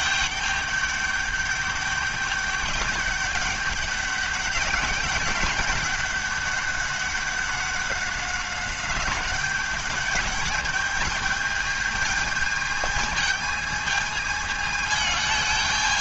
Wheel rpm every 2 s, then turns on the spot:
210, 200, 200, 200, 190, 200, 210, 220.
none